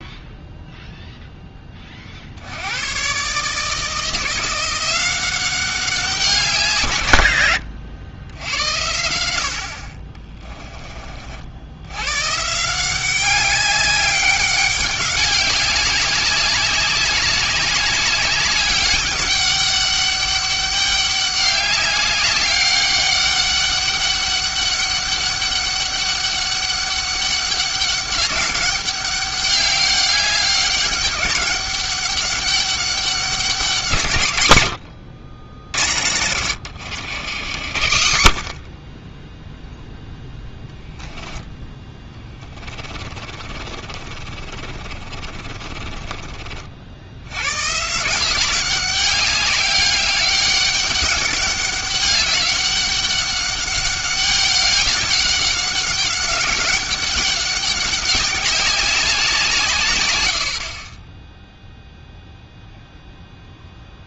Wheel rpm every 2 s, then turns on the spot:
0, 90, 170, 160, 80, 20, 160, 200, 200, 200, 200, 200, 200, 200, 200, 200, 200, 100, 90, 30, 0, 20, 50, 70, 200, 200, 200, 200, 200, 200, 50, 0.
36-38 42-46